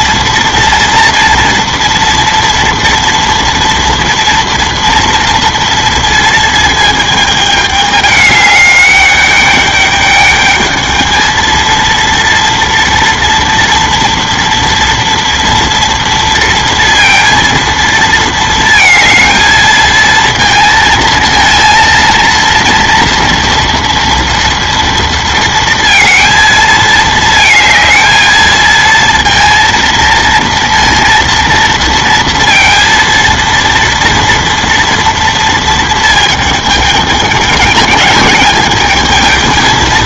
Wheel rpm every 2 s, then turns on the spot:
230, 230, 230, 220, 210, 220, 230, 230, 230, 220, 230, 230, 230, 220, 230, 230, 230, 230, 220, 220.
none